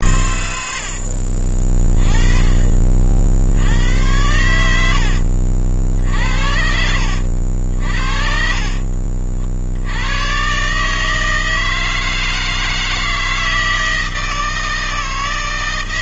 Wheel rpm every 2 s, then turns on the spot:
60, 60, 70, 70, 50, 150, 160, 140.
0-2 4-6